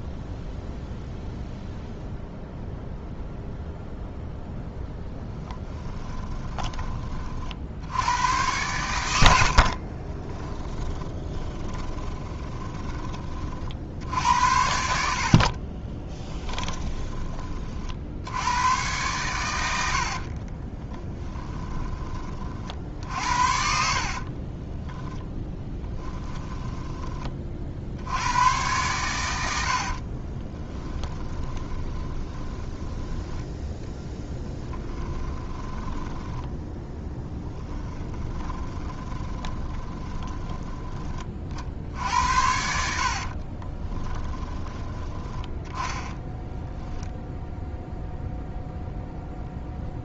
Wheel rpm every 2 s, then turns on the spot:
0, 0, 0, 20, 100, 10, 20, 70, 10, 110, 30, 50, 10, 10, 110, 20, 10, 10, 10, 10, 20, 70, 10, 0, 0.
10-14 16-18 20-22 24-26 30-40